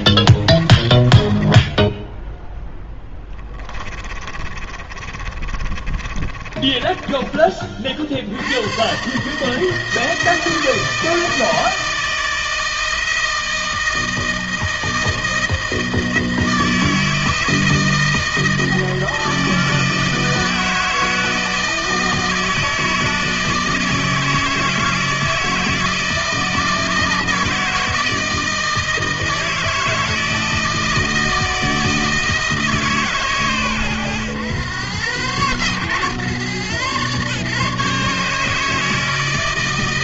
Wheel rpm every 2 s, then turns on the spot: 20, 10, 40, 30, 120, 160, 160, 160, 160, 160, 160, 160, 160, 160, 160, 160, 150, 120, 130, 160.
0-8